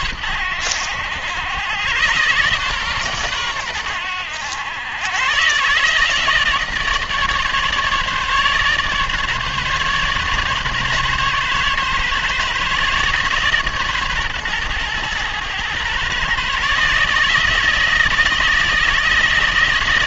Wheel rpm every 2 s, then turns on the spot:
80, 130, 100, 160, 150, 140, 140, 120, 150, 160.
none